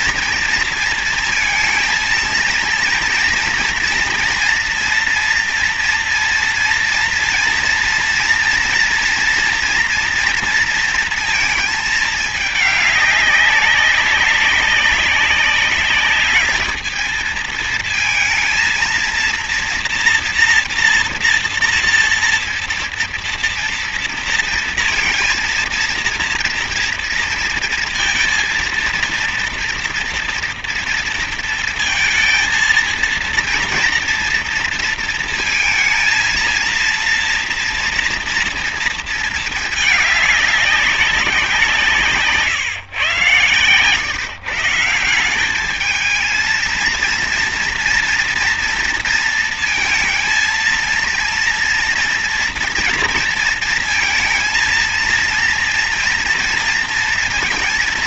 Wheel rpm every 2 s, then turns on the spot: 230, 230, 230, 230, 230, 230, 210, 200, 210, 230, 230, 230, 230, 230, 230, 240, 230, 230, 230, 230, 210, 150, 150, 230, 230, 230, 230, 230, 230.
none